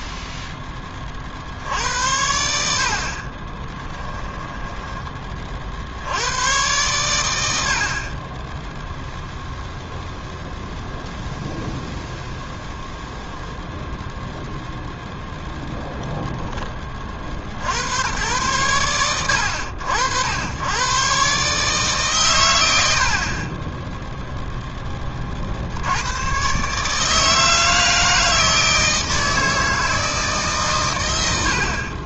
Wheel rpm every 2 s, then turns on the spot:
20, 60, 10, 110, 10, 0, 0, 0, 20, 100, 100, 110, 10, 140, 160, 120.
4-6